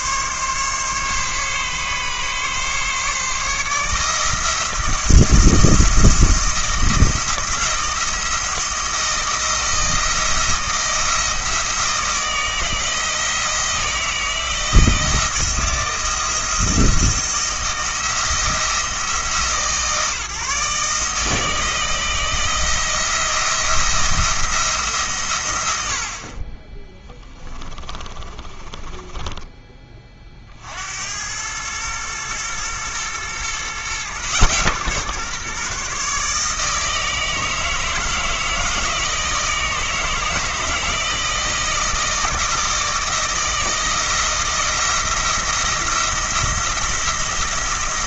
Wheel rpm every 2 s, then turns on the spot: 140, 140, 160, 170, 170, 170, 160, 160, 170, 160, 150, 170, 160, 30, 30, 50, 110, 130, 150, 160, 160, 160, 170, 170.
26-30